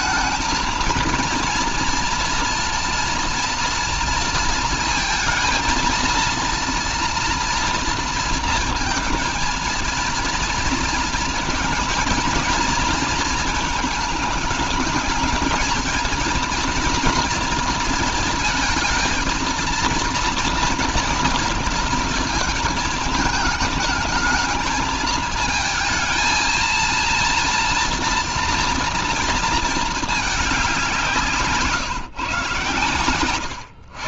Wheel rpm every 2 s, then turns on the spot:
220, 230, 230, 230, 230, 230, 230, 220, 230, 230, 230, 220, 220, 230, 230, 180, 130.
none